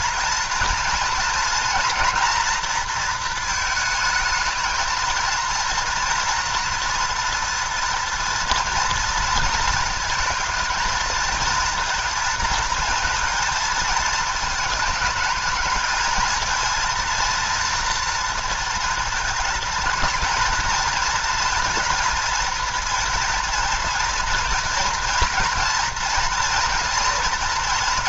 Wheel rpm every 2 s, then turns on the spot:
230, 230, 220, 230, 230, 220, 230, 220, 230, 230, 230, 230, 230, 230.
none